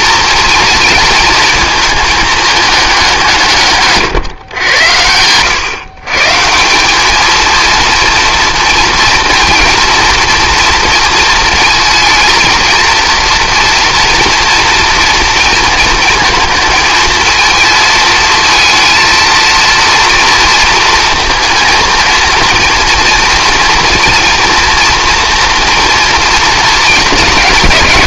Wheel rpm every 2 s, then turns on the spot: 230, 200, 100, 190, 230, 230, 230, 230, 230, 230, 230, 230, 240, 220.
none